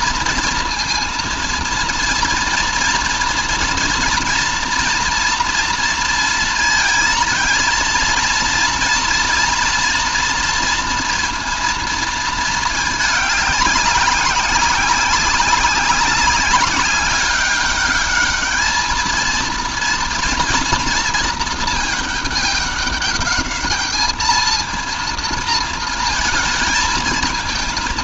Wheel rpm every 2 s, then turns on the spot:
240, 230, 240, 230, 240, 230, 220, 190, 190, 210, 230, 210, 220, 220.
none